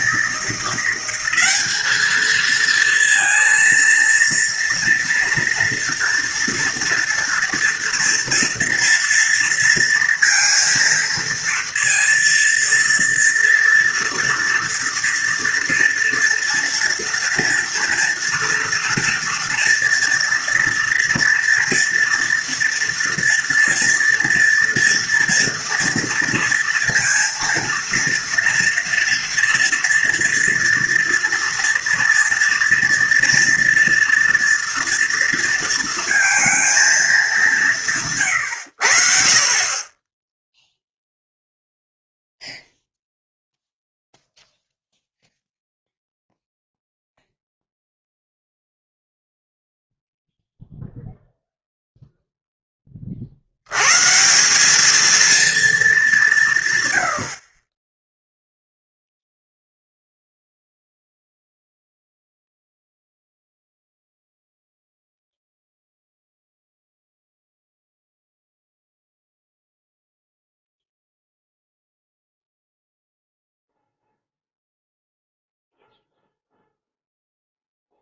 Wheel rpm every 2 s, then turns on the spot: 180, 230, 230, 230, 230, 230, 230, 230, 230, 230, 230, 230, 230, 230, 230, 230, 230, 240, 220, 90, 0, 0, 0, 0, 0, 0, 10, 200, 150, 0, 0, 0, 0, 0, 0, 0, 0, 0, 0.
none